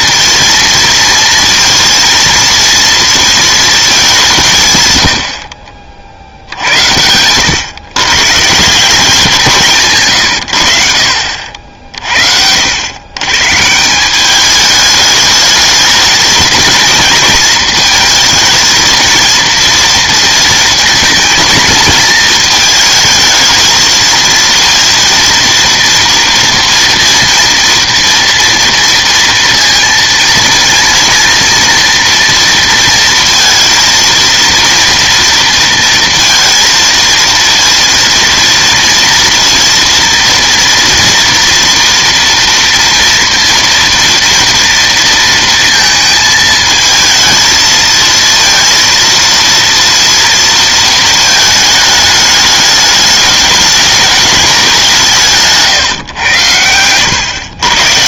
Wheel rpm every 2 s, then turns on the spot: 230, 230, 150, 80, 160, 80, 90, 210, 220, 220, 230, 230, 230, 230, 230, 230, 230, 230, 230, 230, 230, 230, 230, 220, 230, 230, 210, 190, 100.
none